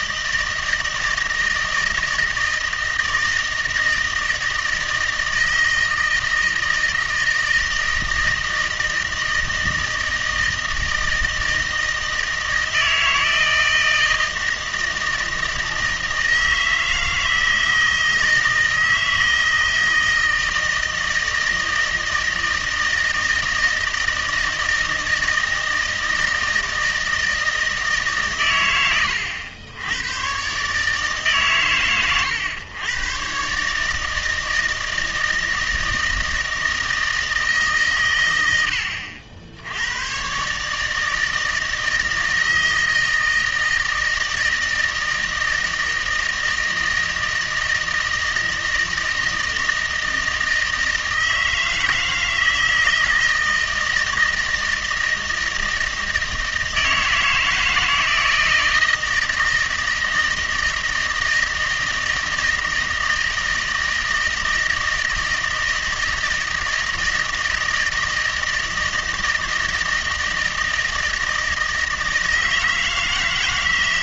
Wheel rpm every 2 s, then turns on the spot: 160, 160, 160, 160, 160, 160, 160, 160, 160, 160, 160, 160, 160, 160, 110, 140, 110, 160, 160, 90, 150, 160, 160, 160, 160, 160, 160, 160, 160, 160, 160, 160, 160, 160, 160, 160, 160.
none